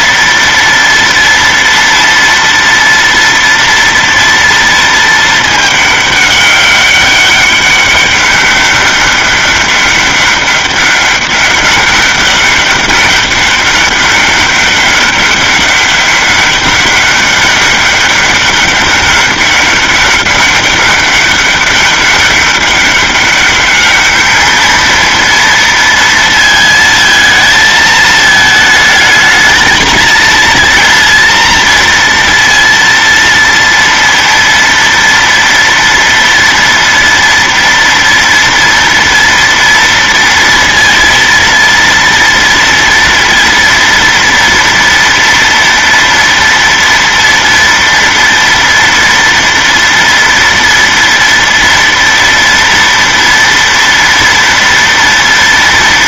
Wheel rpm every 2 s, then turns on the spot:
230, 230, 230, 200, 200, 200, 200, 200, 200, 200, 200, 200, 220, 230, 220, 230, 230, 230, 230, 230, 230, 230, 230, 230, 230, 230, 230, 230.
none